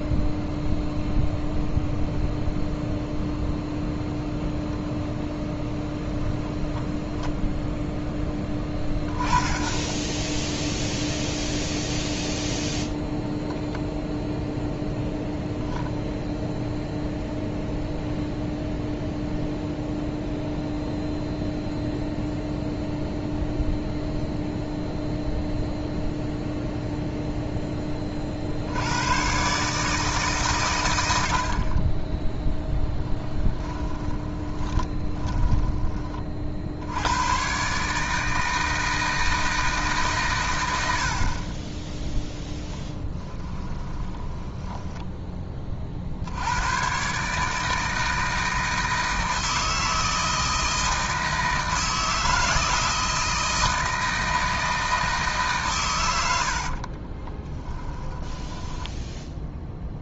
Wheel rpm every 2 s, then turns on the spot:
0, 0, 0, 0, 10, 0, 0, 0, 0, 0, 0, 0, 0, 0, 90, 110, 10, 20, 80, 160, 80, 10, 10, 110, 160, 160, 160, 160, 50, 10.
34-36 42-46 56-60